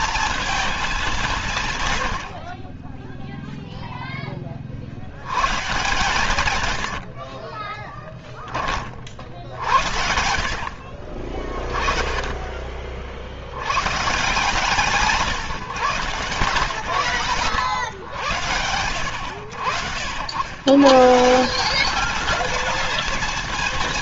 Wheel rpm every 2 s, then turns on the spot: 210, 30, 60, 100, 40, 50, 40, 170, 110, 90, 140, 230.
6-8